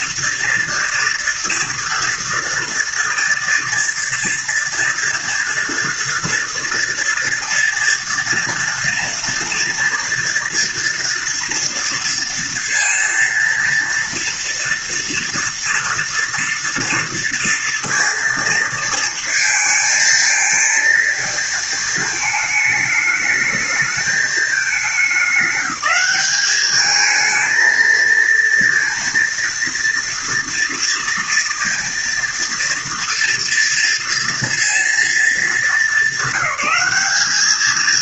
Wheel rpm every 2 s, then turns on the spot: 230, 230, 230, 230, 230, 230, 230, 230, 230, 220, 220, 210, 200, 220, 230, 230, 230, 230, 200.
none